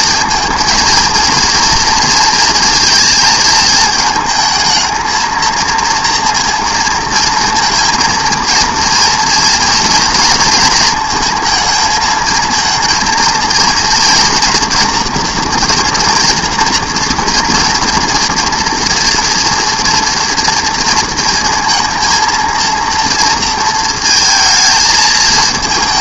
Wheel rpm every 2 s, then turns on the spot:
230, 230, 220, 230, 230, 230, 230, 240, 230, 230, 230, 230, 220.
none